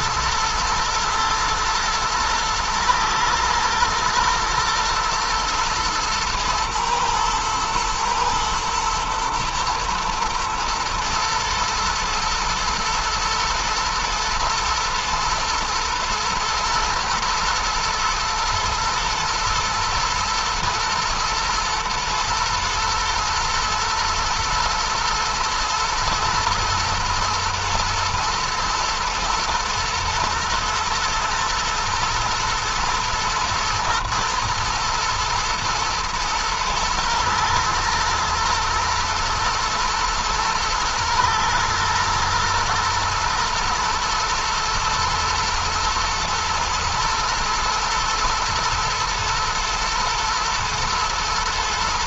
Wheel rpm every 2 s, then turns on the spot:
120, 110, 110, 110, 120, 120, 120, 120, 120, 110, 120, 120, 120, 120, 120, 110, 120, 120, 110, 110, 110, 110, 120, 110, 110, 120.
none